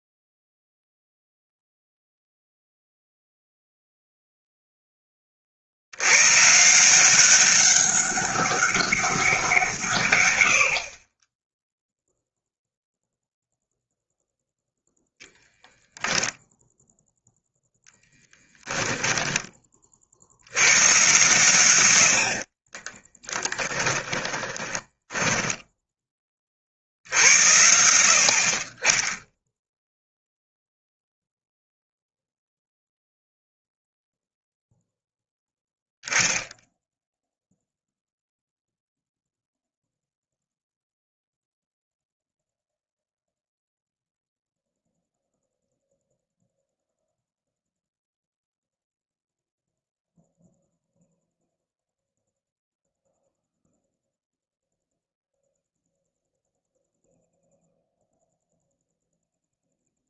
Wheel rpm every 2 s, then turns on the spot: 0, 0, 10, 180, 190, 50, 0, 0, 0, 10, 110, 20, 10, 60, 20, 0, 0, 0, 0, 0, 0, 0, 0, 0, 0, 0, 0, 0, 0, 0.
18-20 22-26